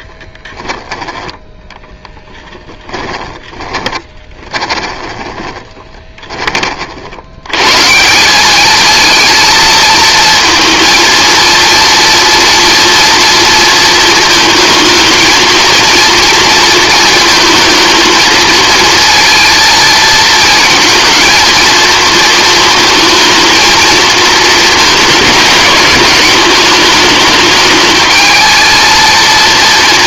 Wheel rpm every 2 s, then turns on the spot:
10, 10, 20, 40, 220, 230, 230, 220, 230, 230, 230, 220, 220, 210, 220.
2-6